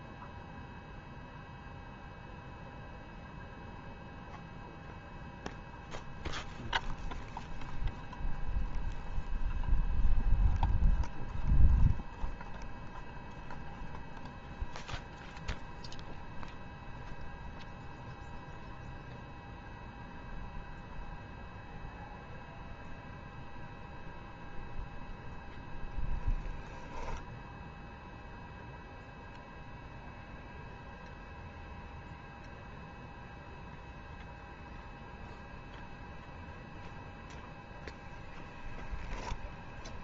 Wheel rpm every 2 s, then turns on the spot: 0, 0, 0, 0, 0, 0, 0, 0, 0, 0, 0, 0, 0, 0, 0, 0, 0, 0, 0, 0.
none